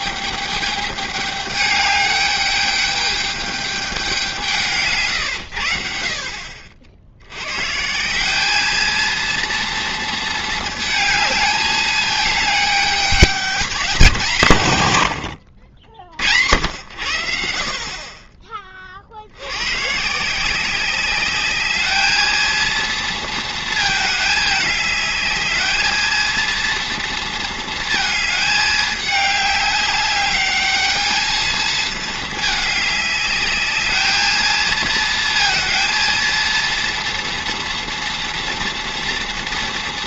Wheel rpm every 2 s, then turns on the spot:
210, 210, 160, 50, 220, 220, 210, 130, 90, 30, 190, 230, 210, 230, 210, 210, 210, 220, 230, 230.
none